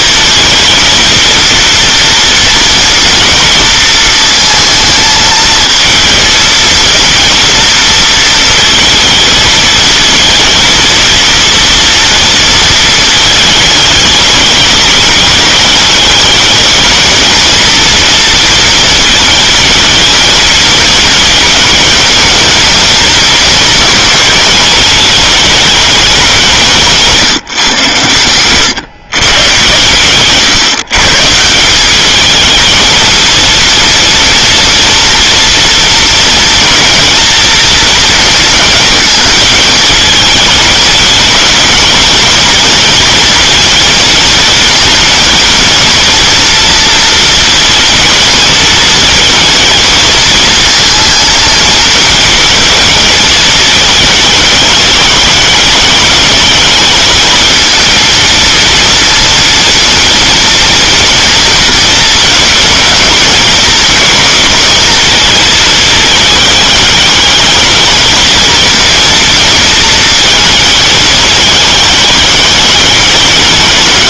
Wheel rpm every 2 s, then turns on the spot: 230, 230, 220, 230, 230, 230, 230, 210, 210, 230, 220, 220, 210, 170, 110, 130, 220, 230, 230, 230, 220, 220, 230, 240, 220, 220, 230, 210, 210, 230, 230, 220, 230, 210, 230, 220, 210.
none